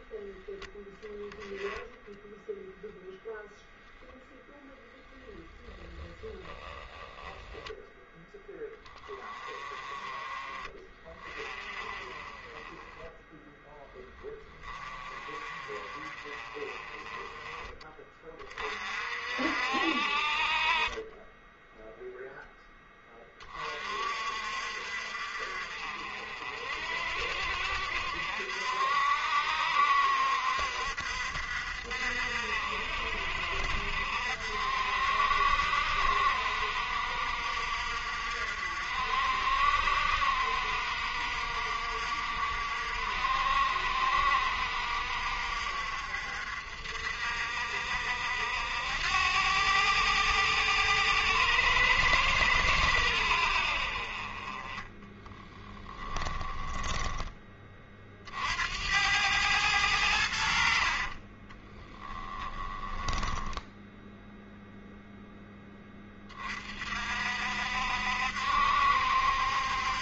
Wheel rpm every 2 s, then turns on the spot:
0, 0, 0, 10, 10, 30, 10, 20, 30, 40, 30, 10, 50, 50, 60, 60, 60, 60, 60, 60, 60, 60, 60, 60, 80, 110, 100, 20, 10, 80, 50, 20, 0, 40, 70.
6-8 54-58 60-64